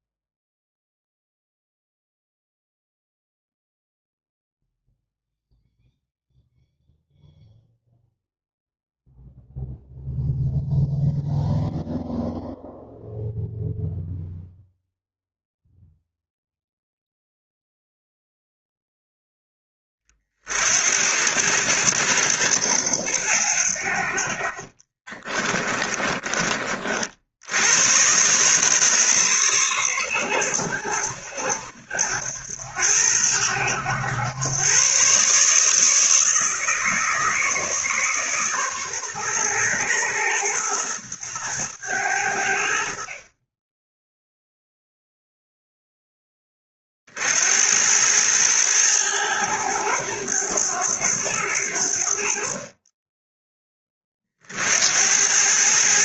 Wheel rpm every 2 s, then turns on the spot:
0, 0, 0, 0, 0, 0, 0, 0, 0, 0, 60, 80, 40, 60, 130, 90, 90, 120, 160, 130, 110, 60, 0, 30, 110, 100, 30, 70.
24-26